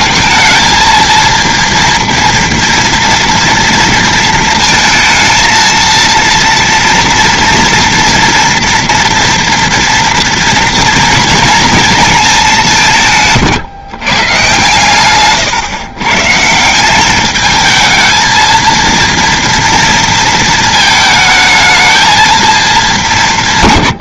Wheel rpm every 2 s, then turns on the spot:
220, 230, 230, 230, 230, 240, 230, 140, 130, 220, 230, 220.
none